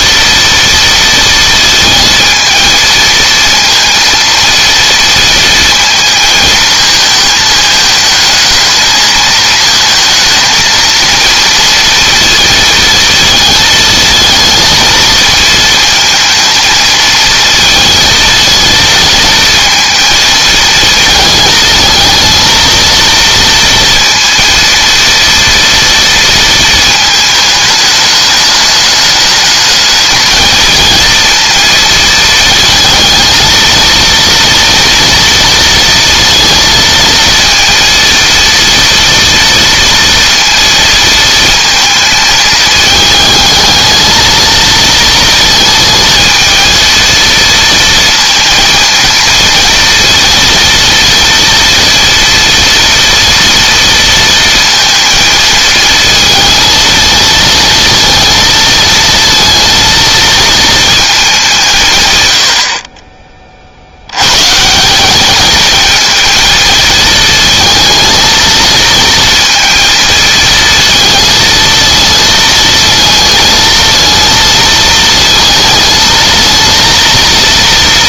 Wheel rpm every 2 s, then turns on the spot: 230, 230, 230, 220, 220, 230, 220, 220, 230, 230, 220, 230, 230, 220, 210, 230, 230, 230, 230, 230, 230, 220, 230, 230, 230, 230, 230, 230, 230, 230, 210, 40, 180, 230, 230, 220, 220, 230, 230.
none